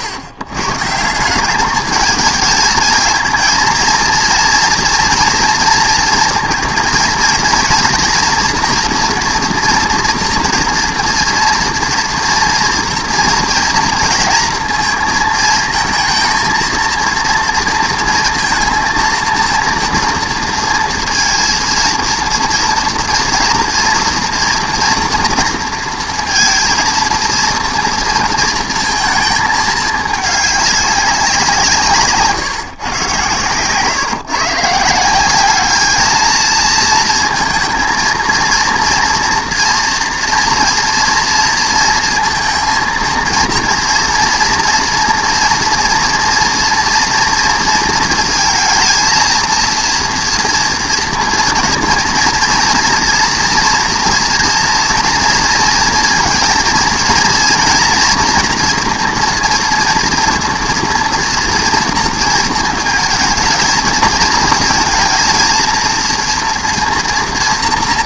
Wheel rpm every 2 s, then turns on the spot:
120, 220, 230, 230, 230, 240, 230, 230, 230, 230, 230, 230, 240, 230, 230, 200, 140, 150, 220, 230, 230, 230, 240, 230, 230, 230, 230, 240, 230, 230, 230, 220, 220, 230.
none